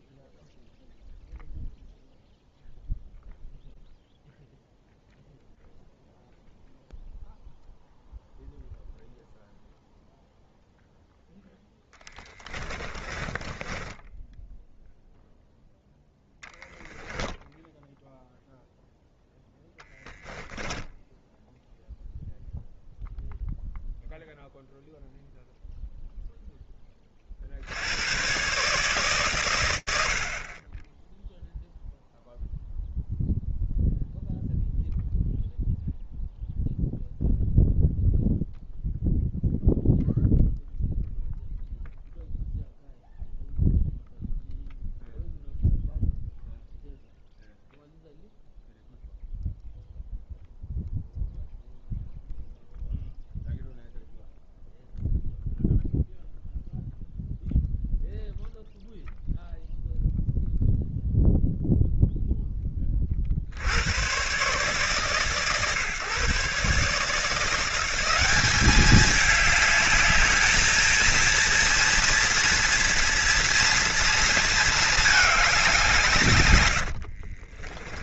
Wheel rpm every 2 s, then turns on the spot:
0, 0, 0, 0, 0, 0, 20, 0, 10, 10, 10, 0, 0, 30, 130, 0, 0, 0, 0, 0, 0, 0, 0, 0, 0, 0, 0, 0, 0, 0, 0, 20, 130, 140, 200, 210, 230, 220, 110.
12-14 16-18